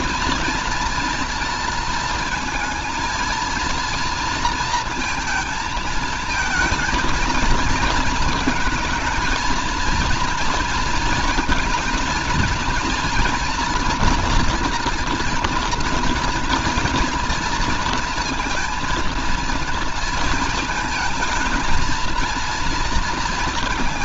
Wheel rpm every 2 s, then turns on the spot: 230, 220, 230, 220, 230, 230, 230, 240, 230, 230, 230, 230.
none